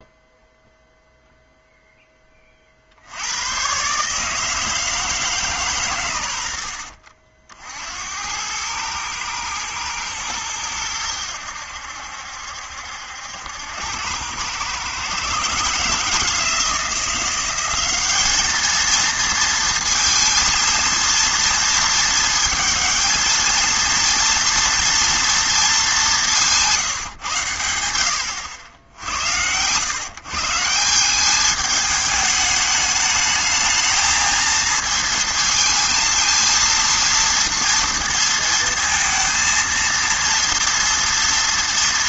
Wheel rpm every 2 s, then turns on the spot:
0, 50, 160, 70, 110, 100, 70, 120, 170, 220, 230, 220, 230, 160, 80, 170, 210, 230, 230, 230, 230.
none